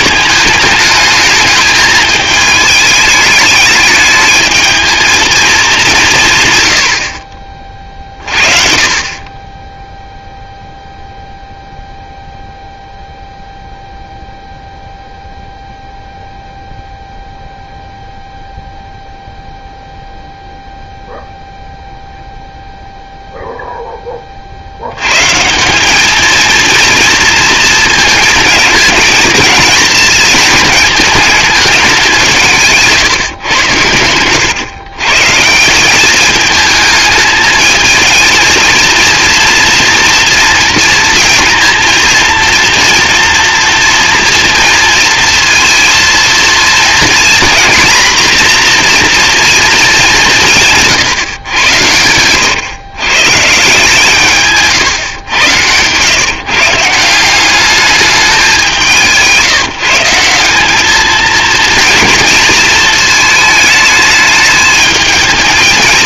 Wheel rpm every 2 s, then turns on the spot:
210, 220, 220, 100, 50, 0, 0, 0, 0, 0, 0, 0, 80, 230, 230, 220, 160, 120, 210, 230, 230, 240, 230, 230, 240, 150, 130, 130, 150, 180, 200, 230, 210.
54-56